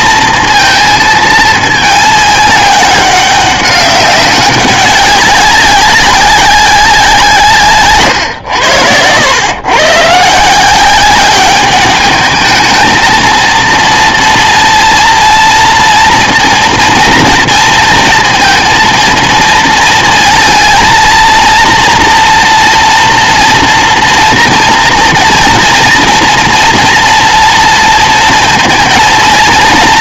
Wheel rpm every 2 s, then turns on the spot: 230, 210, 200, 190, 120, 160, 220, 230, 230, 230, 230, 230, 230, 230, 230.
none